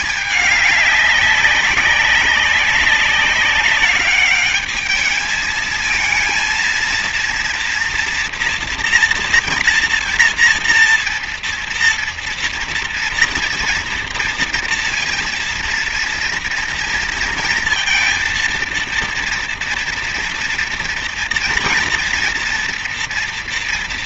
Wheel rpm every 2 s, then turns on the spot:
210, 200, 210, 230, 230, 230, 230, 230, 230, 230, 230, 240.
none